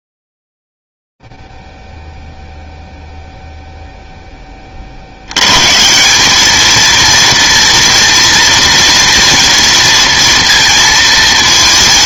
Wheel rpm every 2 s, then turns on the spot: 0, 0, 0, 130, 230, 230.
none